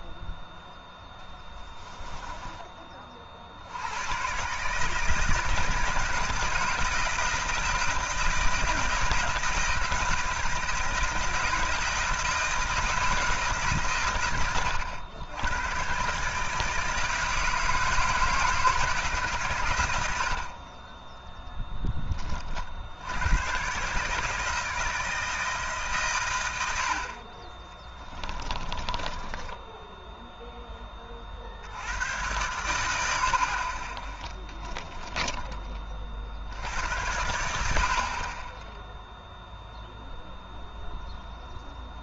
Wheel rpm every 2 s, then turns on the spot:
0, 20, 150, 160, 160, 160, 160, 100, 160, 160, 30, 60, 160, 80, 30, 10, 90, 10, 80, 10, 0.
28-30 34-36